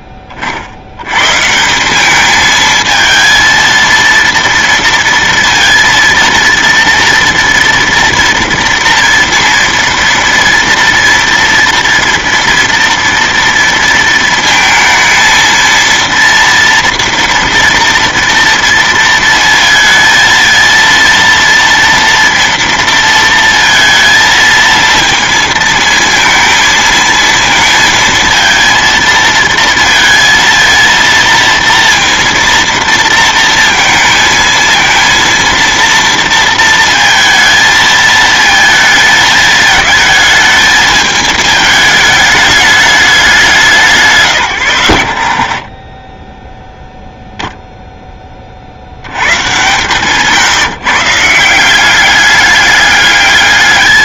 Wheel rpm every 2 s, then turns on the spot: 40, 220, 230, 230, 230, 230, 230, 230, 230, 230, 230, 230, 230, 220, 230, 230, 230, 220, 230, 220, 220, 210, 110, 0, 30, 150, 200.
none